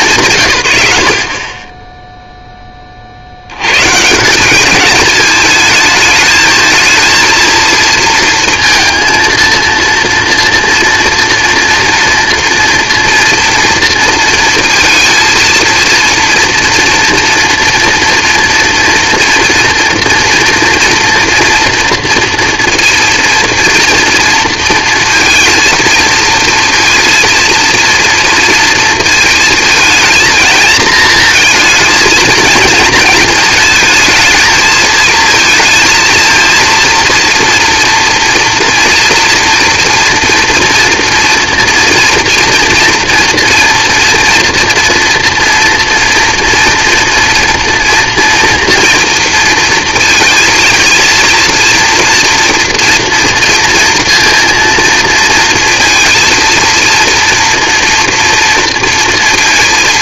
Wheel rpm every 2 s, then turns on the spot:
90, 30, 210, 220, 230, 230, 230, 230, 240, 230, 230, 230, 230, 230, 230, 220, 230, 230, 230, 230, 230, 230, 230, 230, 230, 230, 240, 230, 230, 230.
none